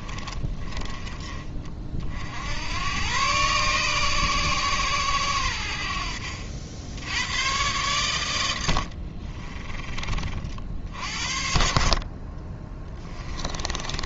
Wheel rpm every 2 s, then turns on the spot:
20, 100, 110, 90, 70, 50, 10.
8-10 12-14